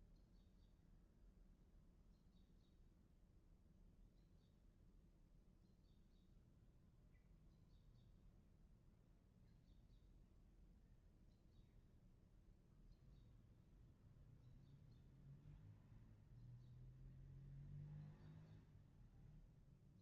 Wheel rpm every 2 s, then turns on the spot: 0, 0, 0, 0, 0, 0, 0, 0, 0, 0.
none